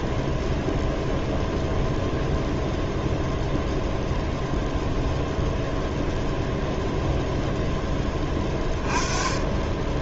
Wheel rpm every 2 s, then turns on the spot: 0, 0, 0, 0, 20.
none